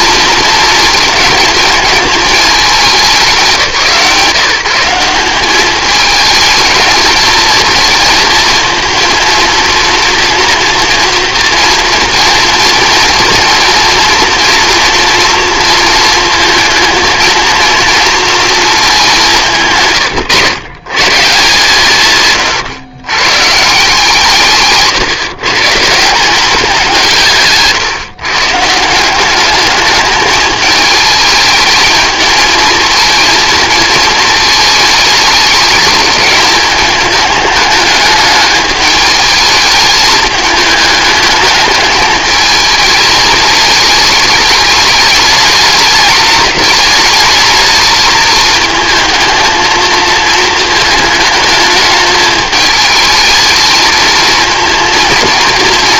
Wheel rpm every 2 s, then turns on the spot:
220, 210, 170, 220, 230, 240, 230, 240, 230, 220, 120, 120, 150, 180, 150, 210, 220, 220, 210, 210, 210, 220, 210, 210, 220, 220, 220, 230.
none